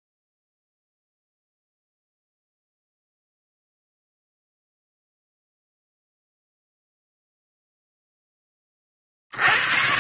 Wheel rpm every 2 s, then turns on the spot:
0, 0, 0, 0, 20.
none